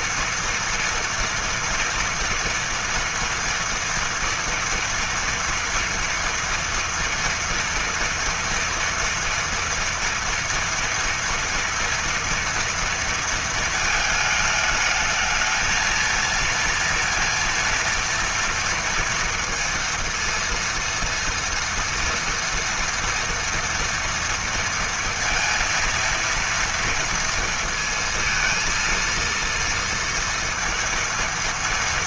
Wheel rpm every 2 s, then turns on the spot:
230, 230, 230, 230, 230, 230, 230, 220, 230, 230, 230, 230, 230, 230, 230, 230.
none